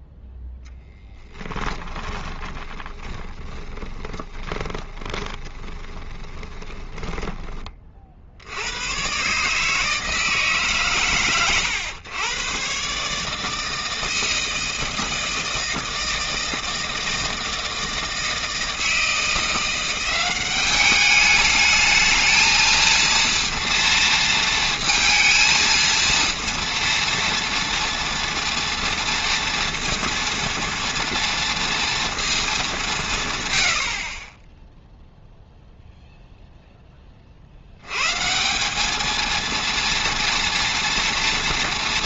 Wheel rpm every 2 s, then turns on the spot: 10, 20, 20, 20, 110, 140, 140, 160, 160, 160, 200, 220, 230, 230, 230, 230, 170, 0, 20, 210, 230.
0-8